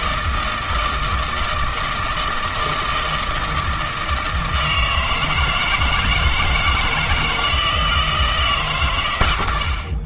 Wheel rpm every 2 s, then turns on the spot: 160, 160, 160, 160, 140.
none